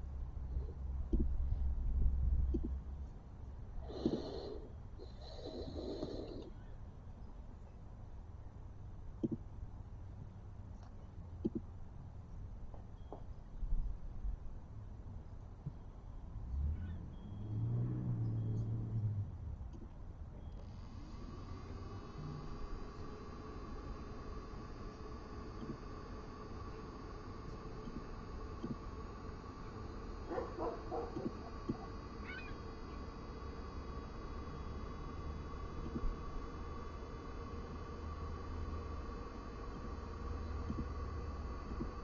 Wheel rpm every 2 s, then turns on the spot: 0, 0, 0, 0, 0, 0, 0, 0, 0, 0, 0, 0, 0, 0, 0, 0, 0, 0, 0, 0, 0.
none